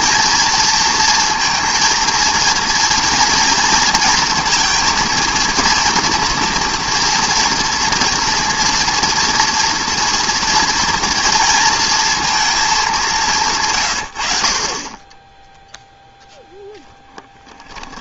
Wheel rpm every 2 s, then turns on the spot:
230, 240, 230, 230, 230, 230, 190, 20, 0.
none